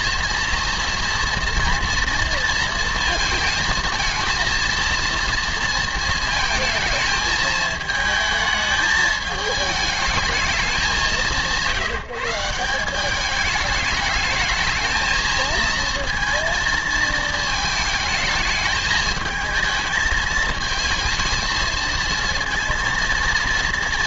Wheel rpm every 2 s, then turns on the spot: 230, 230, 230, 220, 220, 210, 170, 220, 230, 220, 220, 230.
none